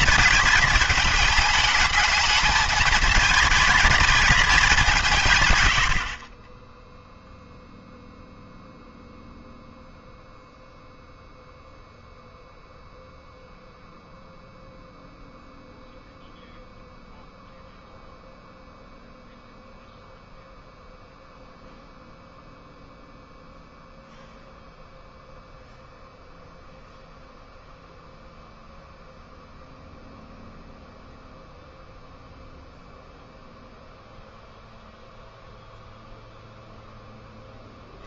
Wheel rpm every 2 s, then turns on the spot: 230, 220, 210, 20, 0, 0, 0, 0, 0, 0, 0, 0, 0, 0, 0, 0, 0, 0, 0.
6-8